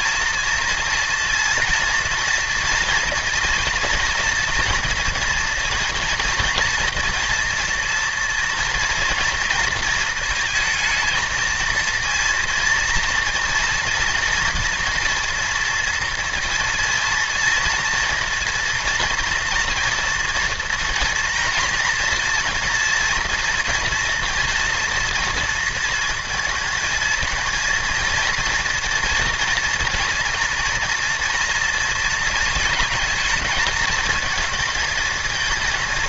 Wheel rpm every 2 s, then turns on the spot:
230, 230, 230, 240, 230, 230, 230, 230, 230, 230, 240, 240, 230, 220, 230, 230, 220, 220.
none